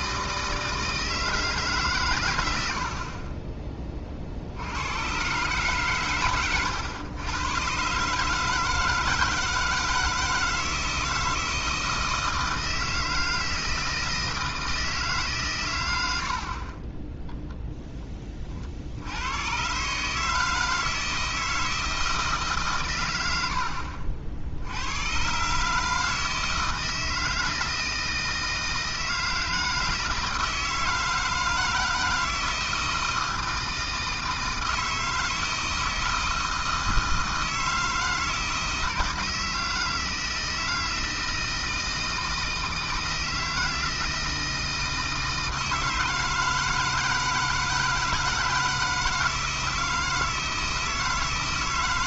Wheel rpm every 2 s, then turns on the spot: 160, 70, 90, 100, 160, 160, 160, 160, 30, 60, 160, 130, 90, 160, 160, 160, 160, 160, 160, 160, 160, 160, 160, 160, 160, 160.
none